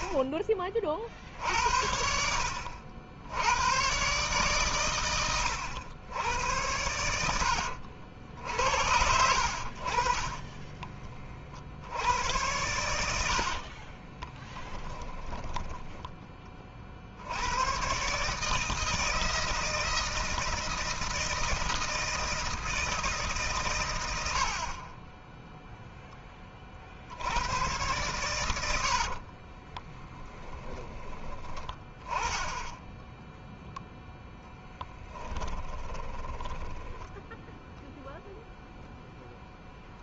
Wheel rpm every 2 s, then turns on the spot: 40, 70, 120, 100, 70, 30, 90, 10, 50, 160, 160, 160, 20, 50, 90, 10, 10, 10, 20, 0.
6-8 12-16 28-30 36-38